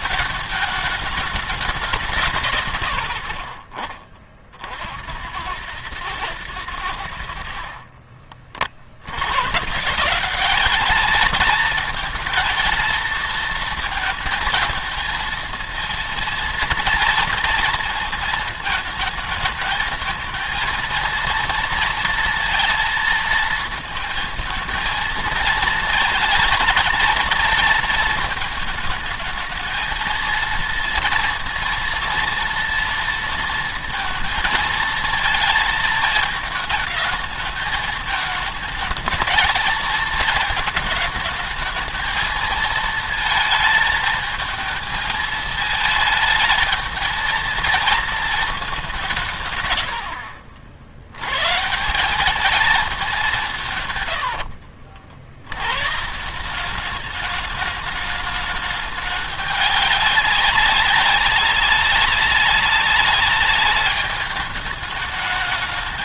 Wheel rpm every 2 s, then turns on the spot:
210, 160, 50, 100, 40, 200, 230, 220, 230, 220, 220, 230, 230, 230, 220, 230, 230, 230, 220, 220, 220, 220, 220, 220, 220, 70, 210, 90, 170, 210, 200, 190, 210.
54-56